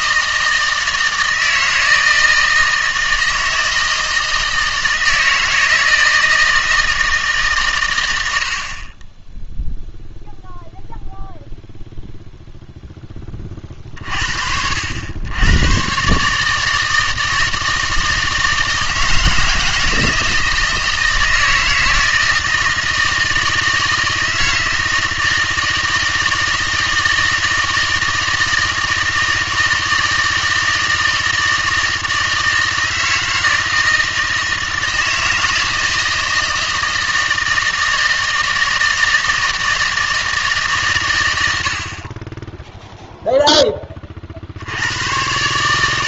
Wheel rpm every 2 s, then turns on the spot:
160, 160, 160, 160, 30, 0, 0, 80, 160, 160, 160, 160, 160, 160, 160, 160, 160, 160, 160, 160, 140, 0, 90.
none